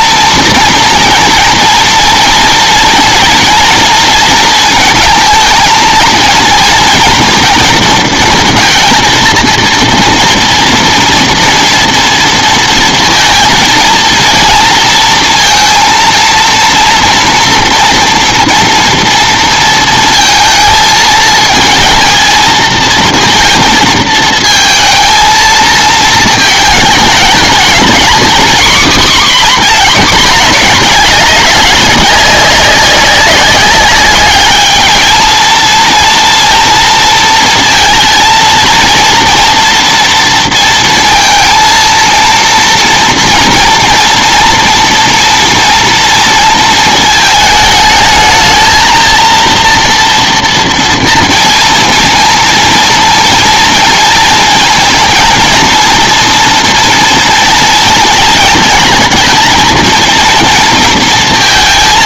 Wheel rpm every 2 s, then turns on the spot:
230, 230, 220, 230, 230, 230, 230, 230, 230, 230, 220, 230, 230, 220, 250, 210, 200, 210, 230, 230, 230, 230, 230, 220, 220, 230, 230, 230, 230, 220, 230.
none